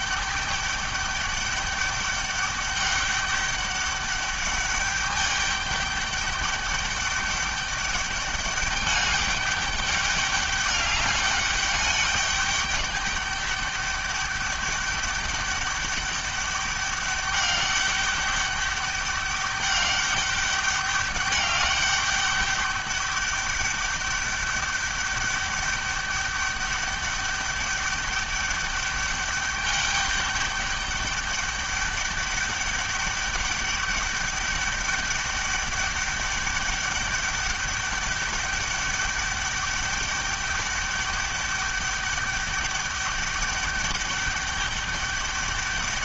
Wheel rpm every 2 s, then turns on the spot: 200, 200, 200, 200, 200, 210, 200, 200, 200, 200, 200, 200, 200, 200, 200, 200, 200, 200, 200, 200, 200, 200, 200.
none